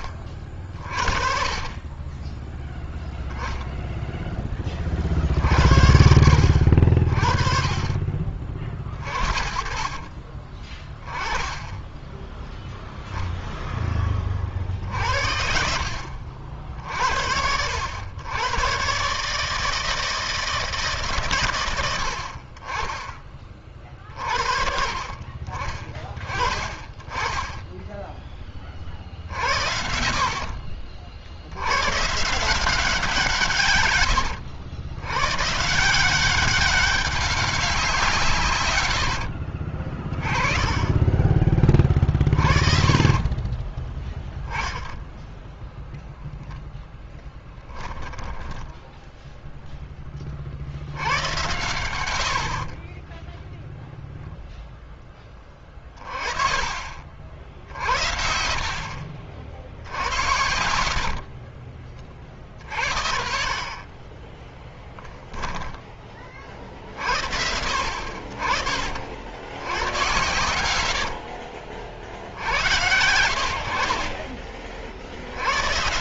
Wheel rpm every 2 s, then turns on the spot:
50, 10, 40, 50, 50, 30, 0, 60, 60, 130, 140, 30, 50, 20, 40, 70, 160, 100, 190, 110, 30, 40, 0, 0, 10, 80, 20, 10, 40, 50, 50, 50, 10, 60, 60, 90, 80, 50.
8-10 38-40 52-54 60-62 70-72